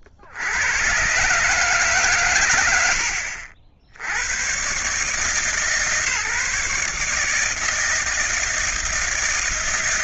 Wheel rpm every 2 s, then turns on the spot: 80, 150, 160, 160, 160.
none